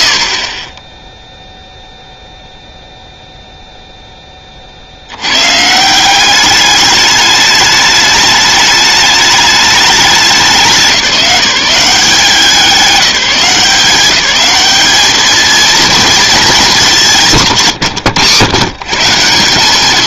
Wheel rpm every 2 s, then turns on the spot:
20, 0, 50, 210, 210, 200, 190, 210, 200, 150.
none